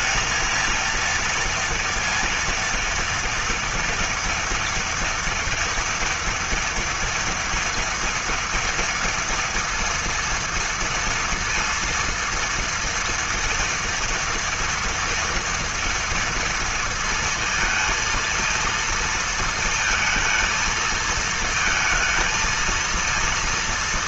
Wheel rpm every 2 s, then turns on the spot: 230, 230, 230, 230, 240, 230, 230, 230, 230, 230, 220, 230.
none